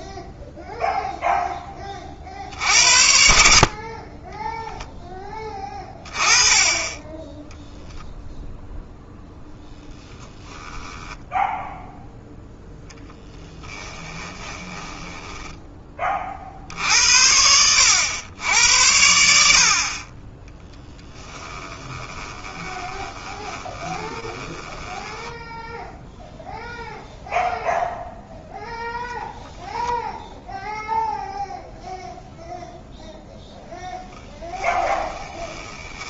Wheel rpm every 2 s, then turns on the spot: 0, 40, 20, 20, 0, 10, 0, 20, 50, 90, 20, 20, 20, 0, 0, 0, 0, 20.
10-12 14-16 22-26 34-36